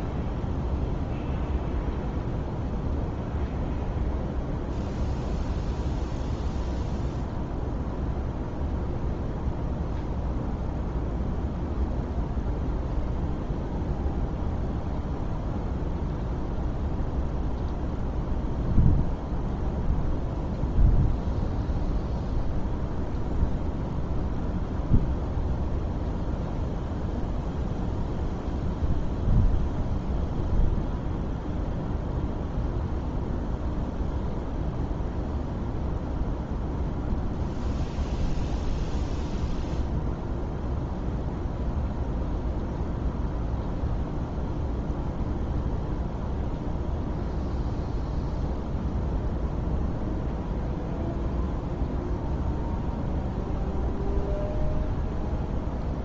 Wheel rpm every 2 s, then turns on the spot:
0, 0, 0, 0, 0, 0, 0, 0, 0, 0, 0, 0, 0, 0, 0, 0, 0, 0, 0, 0, 0, 0, 0, 0, 0, 0, 0, 0.
none